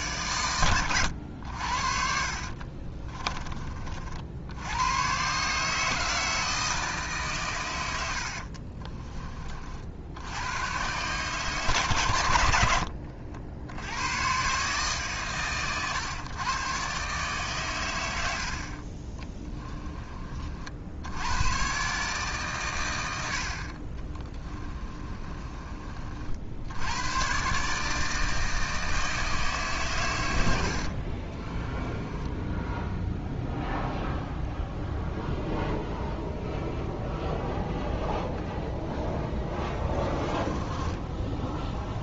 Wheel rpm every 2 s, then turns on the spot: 100, 30, 110, 150, 30, 130, 70, 150, 140, 40, 80, 100, 20, 100, 160, 50, 0, 0, 0, 0, 10.
2-4 8-10 12-14 24-26 30-32